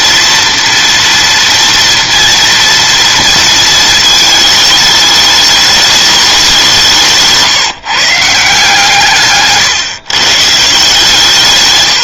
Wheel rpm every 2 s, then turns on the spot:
240, 230, 210, 170, 150, 150.
none